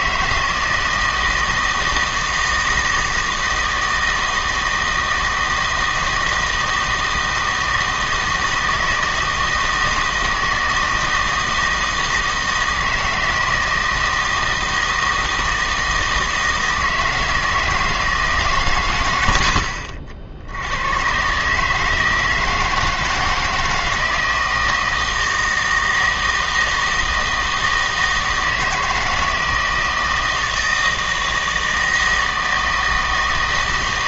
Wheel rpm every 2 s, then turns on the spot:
160, 160, 160, 160, 160, 160, 160, 160, 160, 130, 90, 160, 160, 160, 160, 160, 160.
none